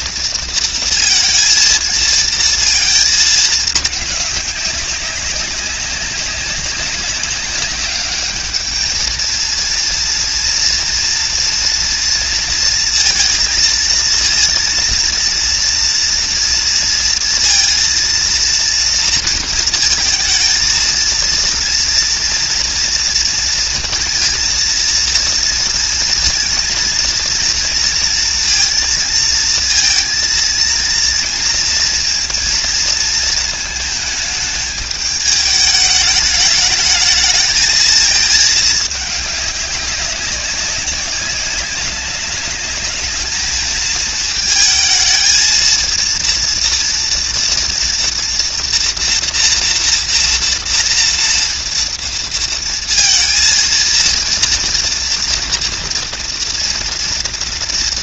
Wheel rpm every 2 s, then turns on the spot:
230, 230, 210, 200, 200, 230, 230, 230, 230, 230, 230, 240, 230, 230, 230, 230, 230, 220, 210, 220, 190, 190, 220, 230, 240, 230, 230, 230, 230.
none